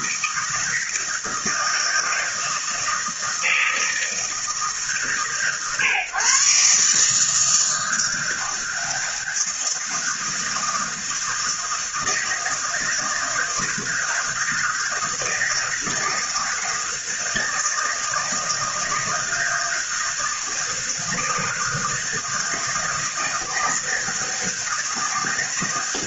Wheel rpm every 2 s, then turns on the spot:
160, 160, 150, 140, 160, 160, 160, 160, 160, 160, 160, 160, 160.
none